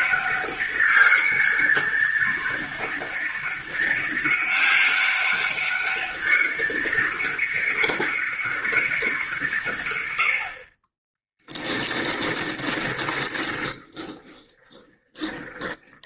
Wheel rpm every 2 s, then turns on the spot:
200, 200, 200, 200, 200, 50, 20, 20.
12-16